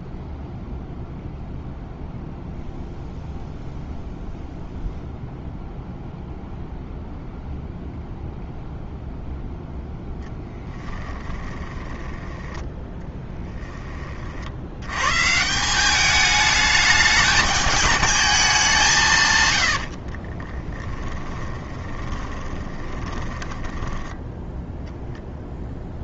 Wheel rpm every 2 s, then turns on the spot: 0, 0, 0, 0, 0, 10, 10, 80, 210, 180, 20, 20, 0.
12-14 20-24